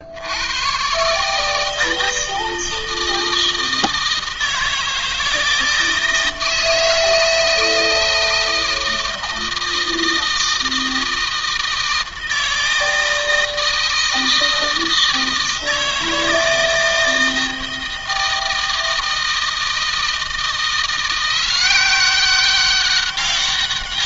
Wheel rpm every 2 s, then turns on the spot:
90, 160, 160, 160, 160, 160, 160, 160, 160, 160, 170, 190.
none